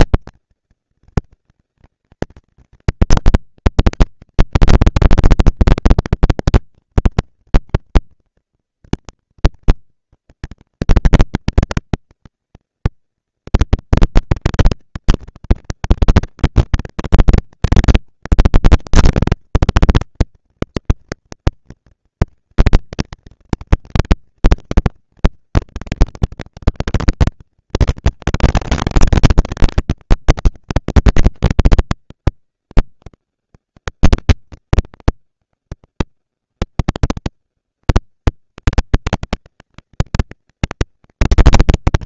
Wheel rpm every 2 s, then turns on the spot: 230, 220, 230, 240, 230, 230, 230, 230, 230, 230, 230, 230, 230, 230, 220, 210, 190, 180, 130, 200, 230.
none